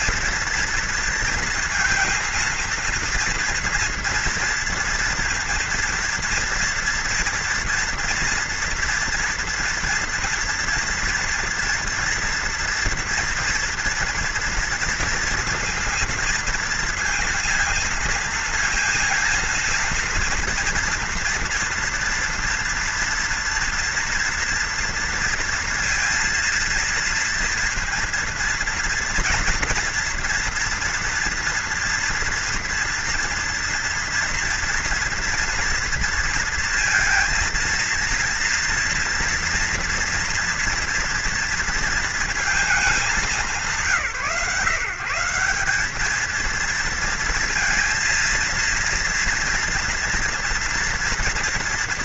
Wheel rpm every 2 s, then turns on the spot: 230, 230, 230, 230, 240, 230, 230, 240, 230, 230, 230, 230, 230, 230, 230, 230, 230, 230, 230, 230, 240, 230, 160, 230, 230, 240.
none